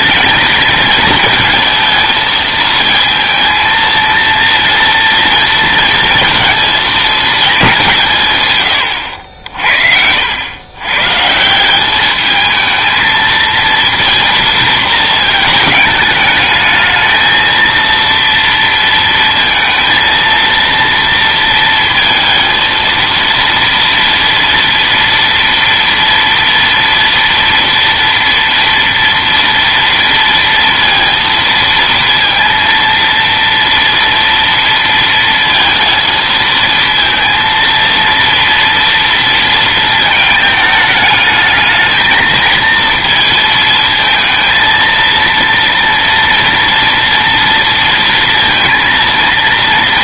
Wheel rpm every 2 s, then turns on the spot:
220, 230, 230, 220, 110, 110, 220, 230, 220, 230, 230, 230, 230, 230, 230, 230, 230, 230, 230, 230, 220, 230, 230, 230, 230.
none